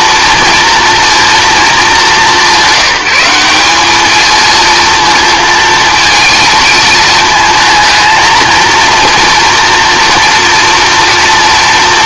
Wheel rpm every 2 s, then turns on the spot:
240, 200, 230, 230, 230, 230.
none